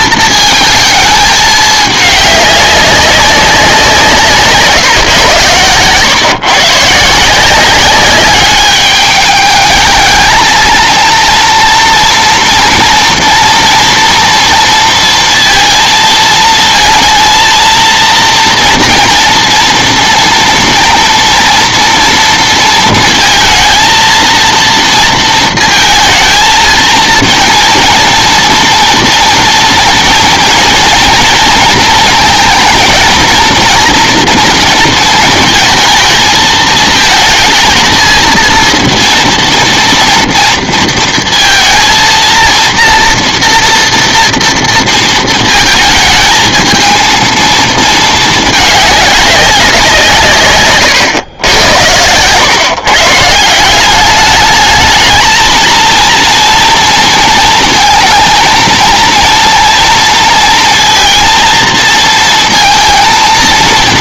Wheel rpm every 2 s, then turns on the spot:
220, 200, 160, 140, 200, 230, 230, 230, 220, 230, 230, 230, 230, 230, 240, 230, 220, 230, 220, 230, 230, 230, 230, 220, 210, 130, 130, 210, 230, 230, 230, 230.
none